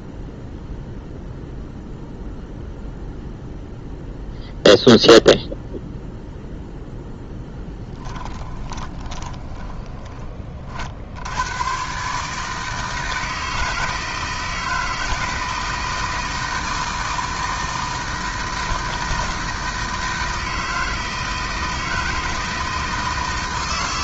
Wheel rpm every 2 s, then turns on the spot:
0, 0, 0, 0, 20, 60, 160, 160, 160, 160, 160, 160.
8-10